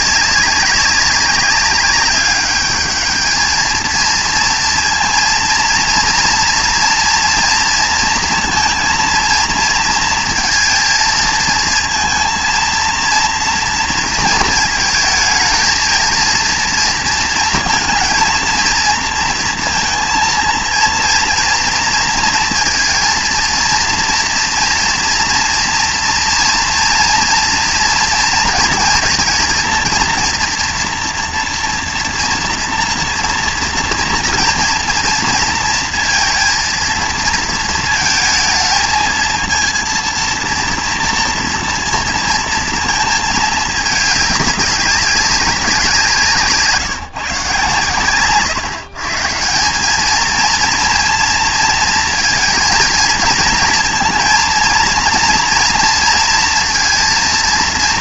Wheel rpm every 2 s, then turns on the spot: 190, 210, 230, 230, 230, 230, 230, 220, 230, 230, 230, 230, 230, 230, 230, 240, 230, 230, 230, 220, 230, 230, 200, 160, 140, 230, 230, 230, 230.
none